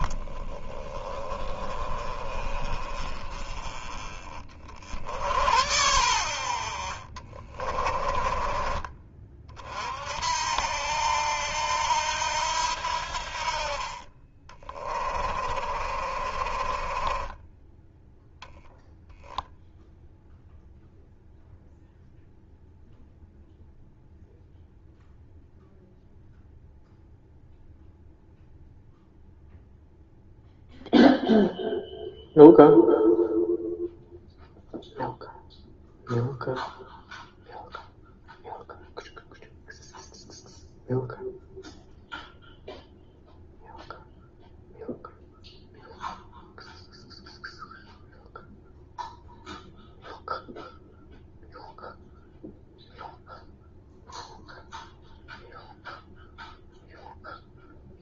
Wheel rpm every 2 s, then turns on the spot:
20, 30, 40, 60, 30, 70, 80, 40, 40, 0, 0, 0, 0, 0, 0, 0, 0, 0, 0, 0, 0, 0, 0, 0, 0, 0, 0, 0, 0.
6-10 14-18